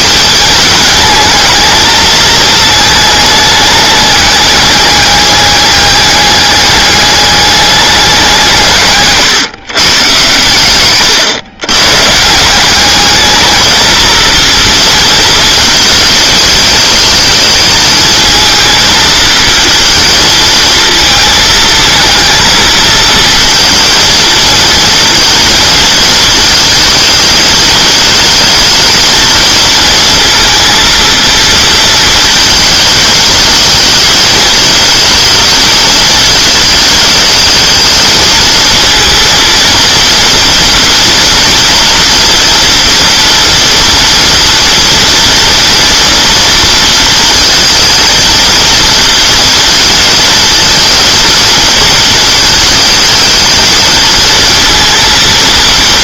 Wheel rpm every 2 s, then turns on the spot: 210, 220, 210, 210, 160, 120, 190, 230, 220, 220, 230, 220, 230, 220, 220, 230, 220, 220, 220, 220, 230, 230, 240, 230, 230, 230, 220, 220.
none